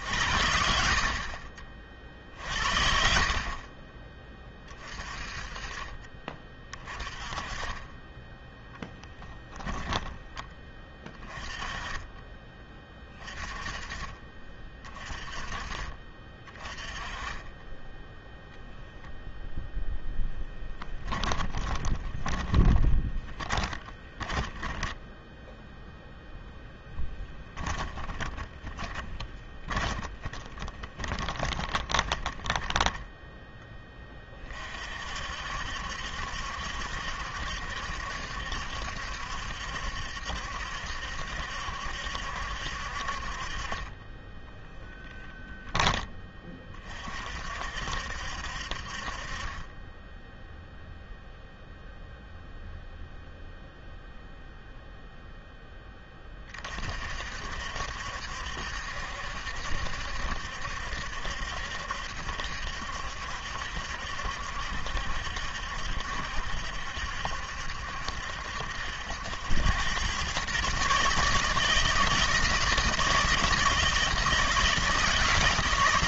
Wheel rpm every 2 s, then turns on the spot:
60, 50, 20, 30, 10, 20, 20, 30, 30, 0, 10, 20, 20, 0, 20, 40, 20, 40, 70, 70, 70, 60, 10, 30, 50, 0, 0, 0, 40, 70, 70, 70, 70, 70, 70, 140, 160, 160.
8-10 20-26 28-34